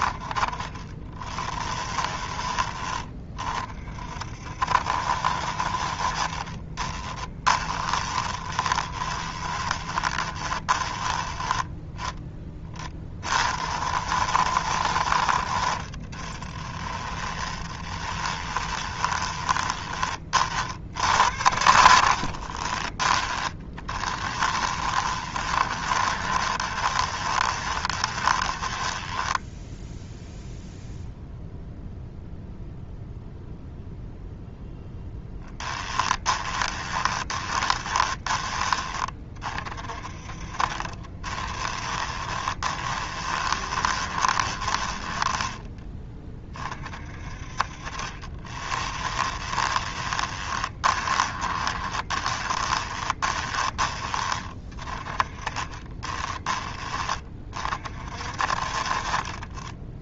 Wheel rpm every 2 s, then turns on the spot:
20, 20, 60, 20, 20, 20, 20, 60, 20, 20, 60, 30, 20, 20, 10, 0, 0, 0, 20, 20, 30, 20, 10, 30, 20, 20, 20, 30, 20, 30.
6-12 16-20 22-30 36-38 40-46 48-54